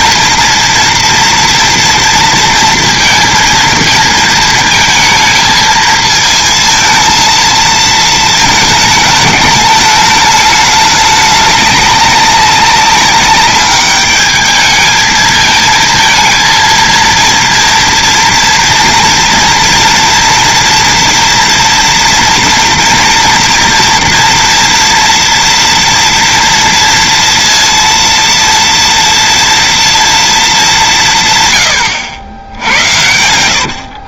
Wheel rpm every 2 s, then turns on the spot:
230, 230, 220, 220, 220, 210, 200, 220, 230, 230, 230, 240, 230, 230, 230, 170, 80.
none